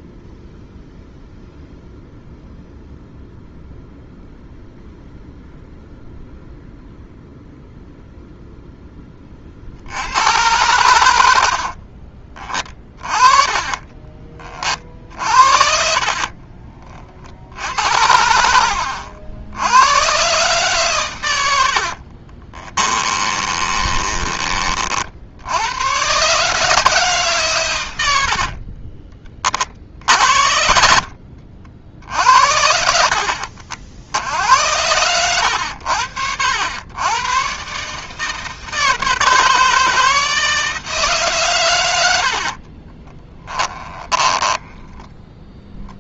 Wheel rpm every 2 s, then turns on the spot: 0, 0, 0, 0, 10, 100, 30, 40, 30, 70, 130, 20, 30, 150, 40, 70, 70, 80, 100, 160, 160, 40, 10.
12-14 22-24 28-30 42-46